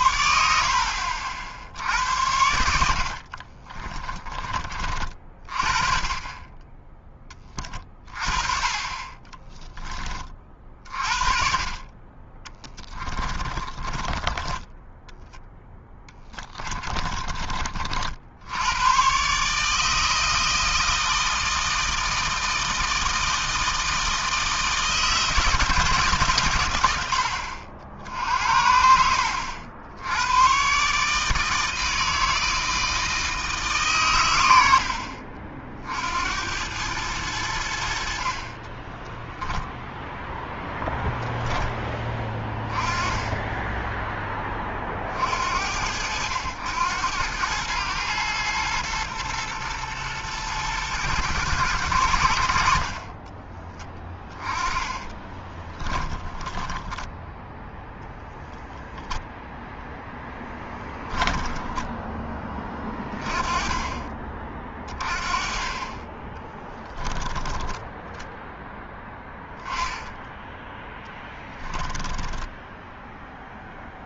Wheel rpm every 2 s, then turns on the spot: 50, 60, 30, 10, 20, 40, 20, 10, 30, 120, 160, 160, 160, 80, 70, 150, 160, 60, 100, 10, 0, 10, 50, 100, 120, 120, 40, 20, 10, 0, 10, 20, 30, 10, 10, 10, 0.
8-10 12-14 16-18 38-40 54-58 70-72